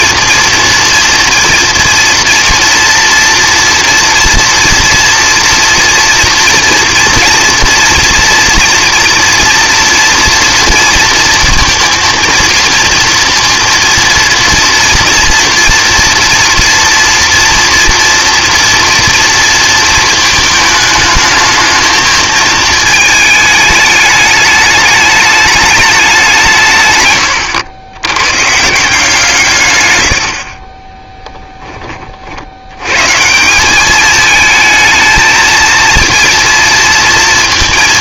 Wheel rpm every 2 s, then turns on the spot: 230, 230, 230, 240, 230, 230, 230, 230, 230, 230, 220, 220, 210, 150, 150, 30, 90, 220, 230.
none